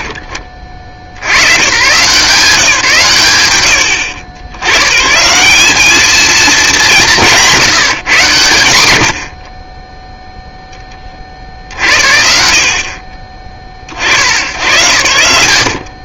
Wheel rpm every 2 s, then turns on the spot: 70, 140, 170, 180, 40, 50, 40, 100.
none